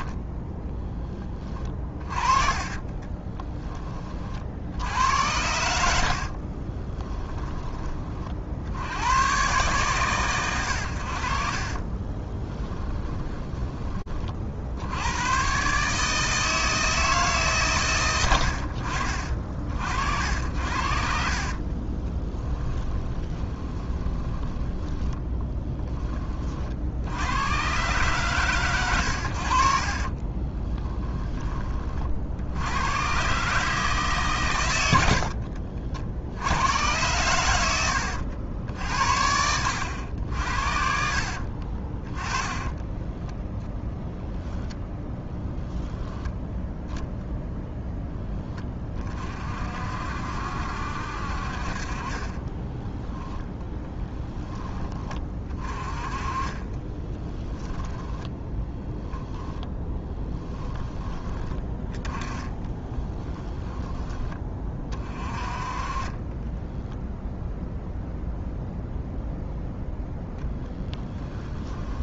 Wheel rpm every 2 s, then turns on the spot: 10, 30, 80, 20, 70, 70, 10, 110, 140, 50, 70, 20, 20, 60, 90, 10, 120, 80, 100, 70, 60, 10, 0, 0, 30, 60, 10, 20, 20, 10, 10, 20, 30, 0, 0, 10.
2-4 6-8 12-14 20-26 30-32 38-44 52-54 56-58 62-64 70-72